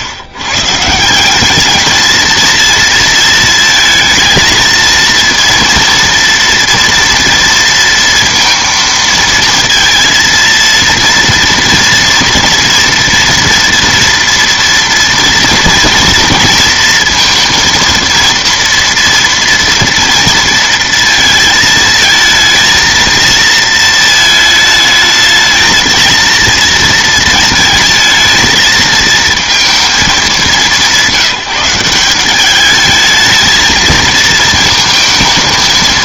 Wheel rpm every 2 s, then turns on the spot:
130, 230, 230, 230, 230, 230, 230, 240, 230, 230, 230, 220, 220, 230, 220, 190, 200, 220.
none